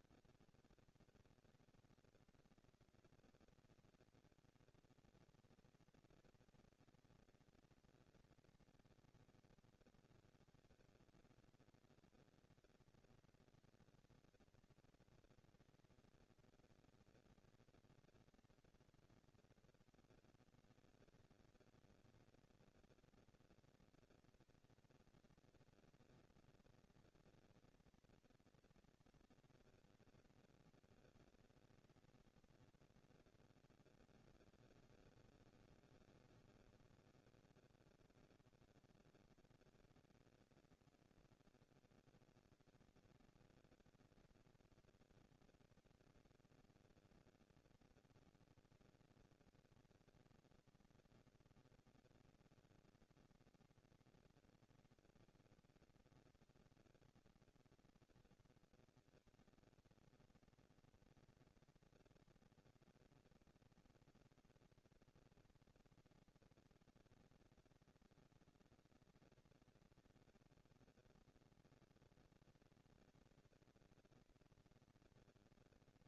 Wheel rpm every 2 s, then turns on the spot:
200, 200, 210, 230, 230, 230, 230, 230, 220, 230, 230, 230, 230, 230, 230, 230, 230, 200, 200, 220, 230, 230, 230, 230, 230, 230, 240, 230, 230, 230, 230, 230, 230, 210, 190, 210, 230, 230.
none